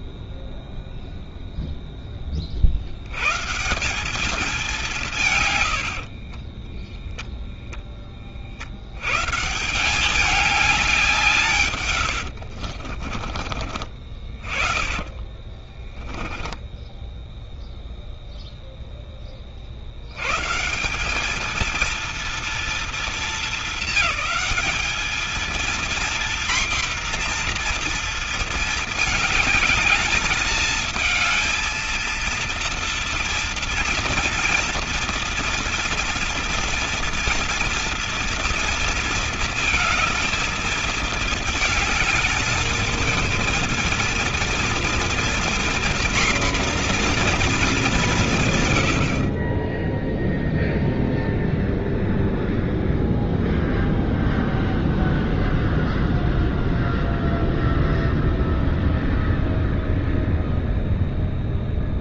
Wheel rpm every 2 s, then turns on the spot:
0, 50, 200, 10, 50, 200, 70, 40, 10, 0, 150, 230, 200, 240, 220, 220, 230, 230, 230, 230, 220, 220, 240, 240, 120, 0, 0, 0, 0, 0, 0.
6-8 12-18